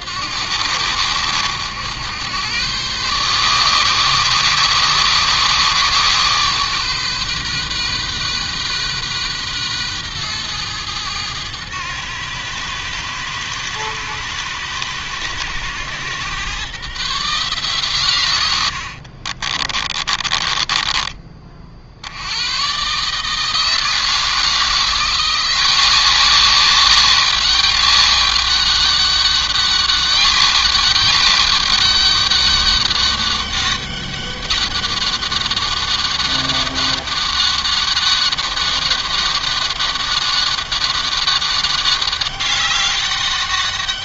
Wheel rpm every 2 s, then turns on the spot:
80, 110, 130, 130, 130, 120, 110, 110, 120, 110, 30, 120, 170, 200, 200, 200, 200, 200, 200, 200, 200, 190.
18-22